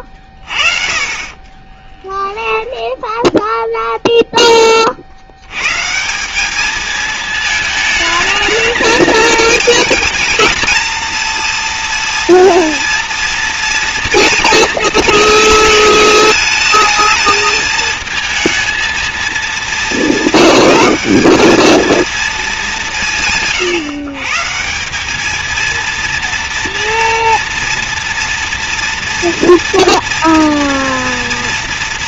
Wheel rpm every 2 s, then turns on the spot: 30, 10, 20, 210, 220, 220, 230, 230, 220, 230, 200, 200, 170, 230, 240, 230.
none